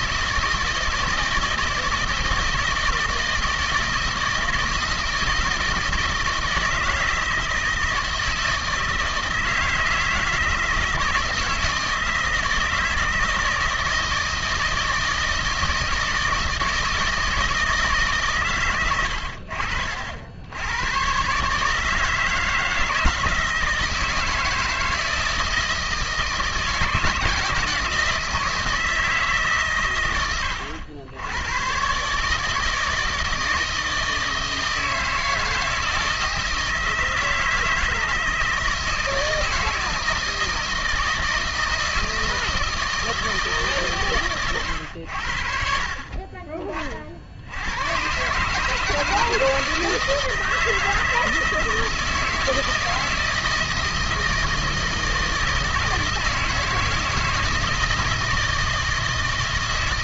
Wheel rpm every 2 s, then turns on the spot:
160, 160, 160, 160, 160, 160, 160, 160, 160, 130, 90, 160, 160, 160, 160, 90, 160, 160, 160, 160, 160, 160, 120, 30, 140, 160, 160, 160, 160, 160.
none